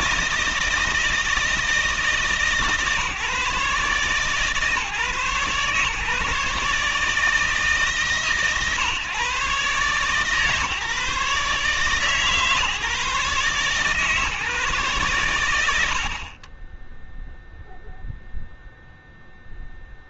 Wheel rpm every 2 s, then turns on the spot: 160, 150, 150, 150, 140, 150, 150, 140, 20, 0.
none